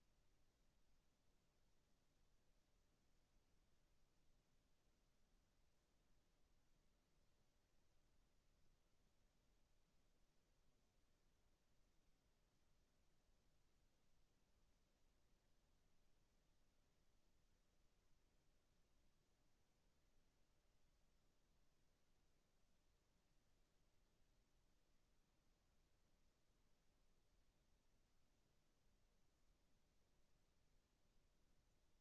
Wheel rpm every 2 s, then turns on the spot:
0, 0, 0, 0, 0, 0, 0, 0, 0, 0, 0, 0, 0, 0, 0, 0.
none